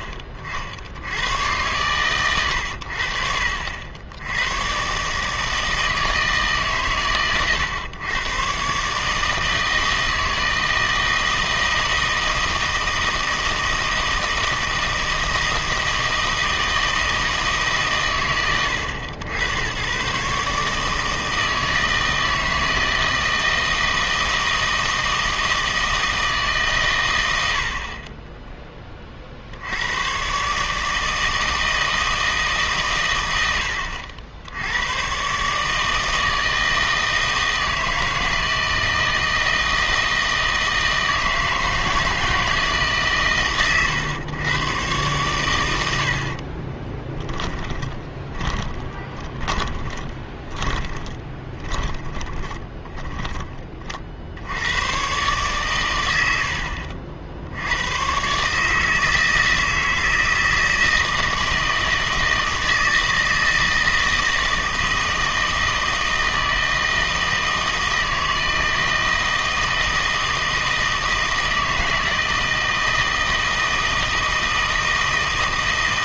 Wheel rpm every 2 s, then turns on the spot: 60, 100, 120, 140, 130, 160, 160, 160, 160, 100, 150, 160, 160, 140, 20, 150, 140, 90, 160, 160, 160, 150, 120, 30, 20, 20, 20, 90, 70, 150, 160, 160, 160, 160, 160, 160, 160, 160.
46-54